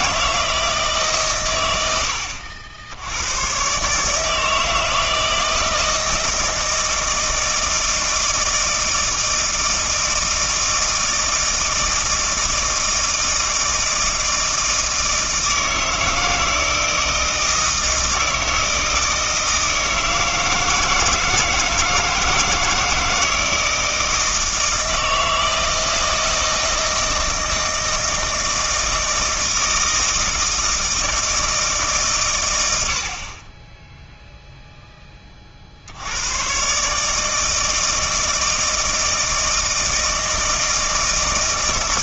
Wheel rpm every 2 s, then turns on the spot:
160, 80, 160, 160, 160, 160, 160, 160, 160, 160, 160, 160, 160, 160, 160, 160, 90, 0, 130, 160, 160.
none